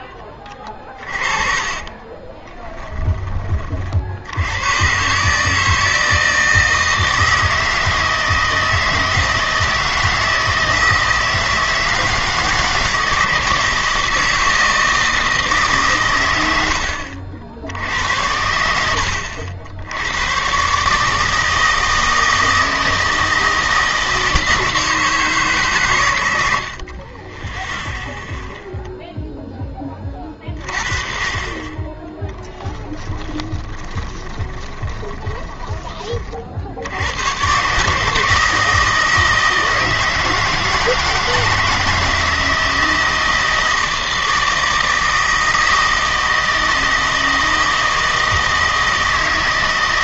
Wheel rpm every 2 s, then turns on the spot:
20, 10, 120, 160, 160, 160, 160, 160, 90, 90, 140, 160, 160, 50, 0, 30, 20, 20, 80, 160, 160, 160, 160, 160, 160.
0-2 32-36